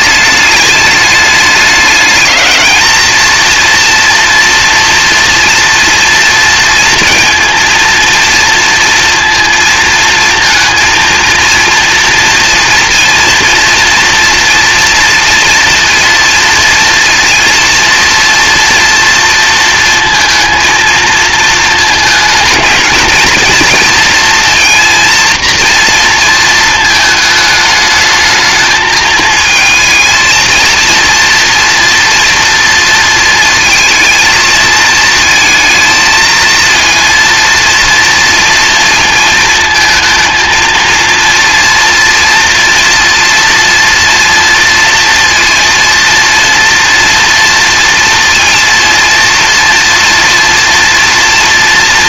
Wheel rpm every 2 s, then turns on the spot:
210, 210, 230, 230, 230, 230, 230, 230, 240, 230, 230, 220, 230, 230, 220, 230, 230, 220, 230, 230, 220, 240, 230, 230, 230, 240.
none